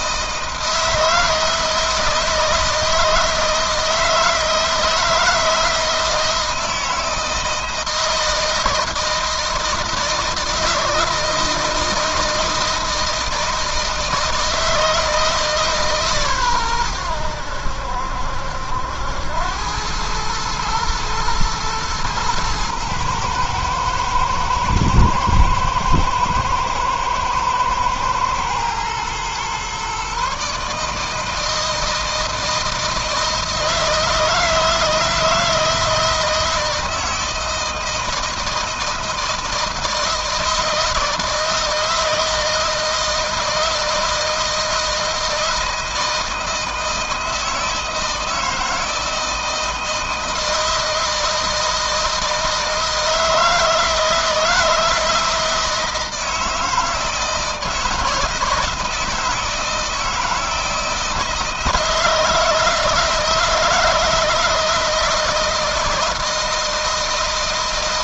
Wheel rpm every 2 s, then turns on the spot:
160, 160, 160, 160, 160, 160, 160, 160, 100, 80, 110, 110, 120, 120, 120, 150, 160, 160, 160, 160, 160, 160, 160, 160, 160, 160, 160, 160, 160, 160, 160, 160, 160, 160.
none